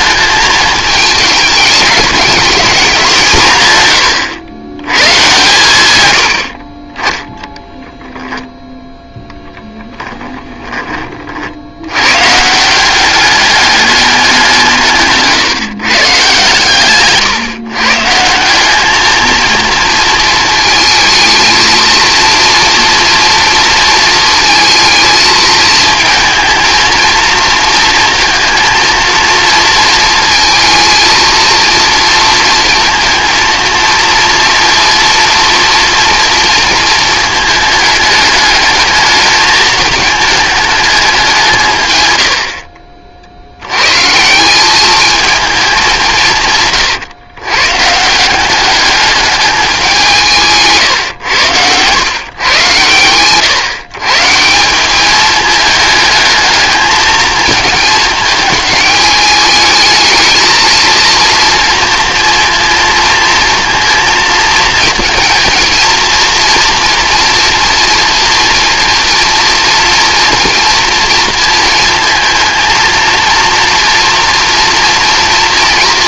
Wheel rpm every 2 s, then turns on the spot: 220, 200, 120, 40, 0, 20, 180, 160, 140, 210, 220, 230, 220, 230, 230, 230, 230, 230, 230, 220, 220, 50, 200, 130, 200, 140, 120, 180, 220, 210, 230, 230, 230, 240, 230, 230, 230, 230.
6-8 16-18 50-52